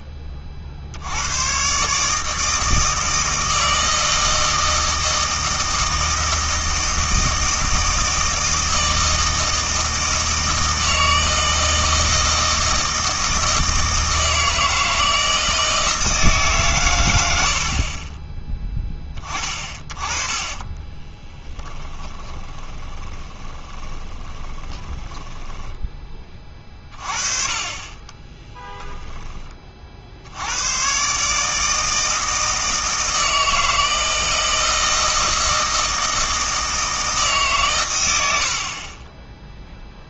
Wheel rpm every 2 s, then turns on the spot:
50, 160, 160, 160, 160, 160, 160, 160, 130, 10, 20, 20, 20, 30, 20, 100, 160, 160, 160, 50.
20-26 28-30